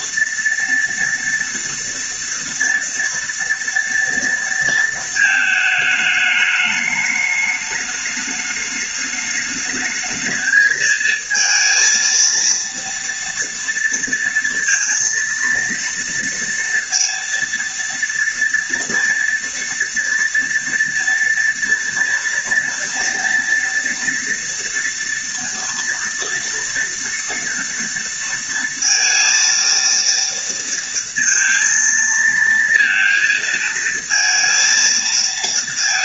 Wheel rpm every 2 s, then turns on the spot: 230, 230, 230, 210, 210, 220, 230, 230, 230, 230, 230, 230, 230, 230, 230, 230, 230, 230.
none